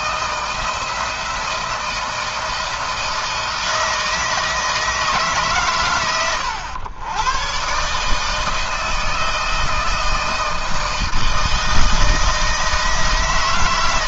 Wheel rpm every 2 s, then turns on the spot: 170, 160, 150, 100, 160, 160, 160.
none